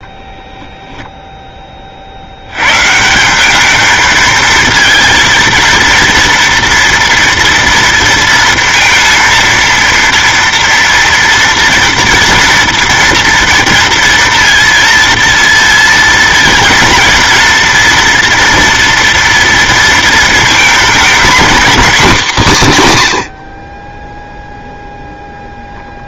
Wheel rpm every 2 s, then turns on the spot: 0, 120, 230, 230, 230, 230, 230, 230, 230, 230, 230, 170, 0.
none